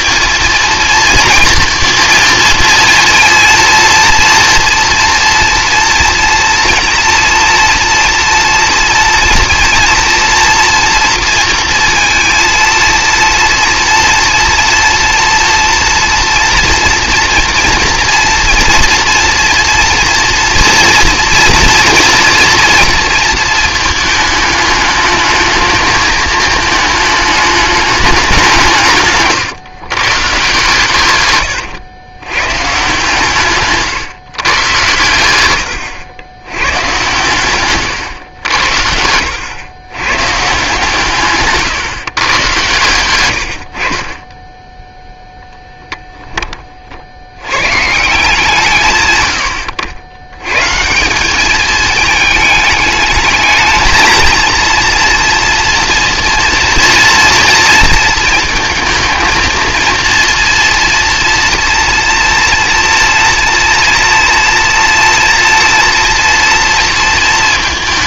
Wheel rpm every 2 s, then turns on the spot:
230, 230, 230, 230, 230, 230, 230, 230, 230, 230, 230, 230, 210, 220, 170, 120, 130, 120, 110, 80, 140, 120, 0, 40, 140, 140, 220, 230, 230, 230, 230, 230, 230, 230.
38-40